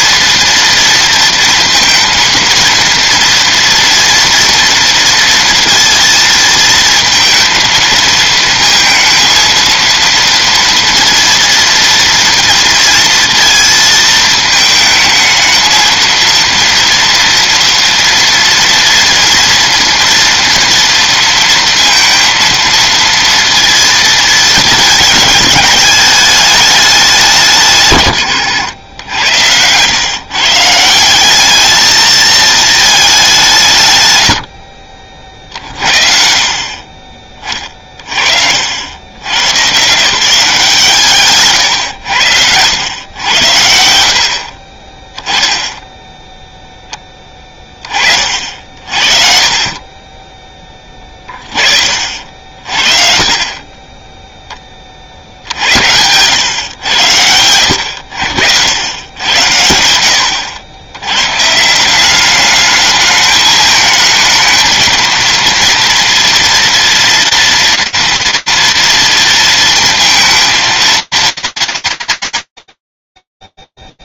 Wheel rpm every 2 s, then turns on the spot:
230, 230, 230, 230, 220, 230, 230, 220, 230, 230, 230, 230, 220, 210, 90, 160, 220, 50, 30, 70, 170, 90, 30, 10, 50, 20, 40, 30, 100, 90, 80, 210, 220, 240, 230, 230, 40.
none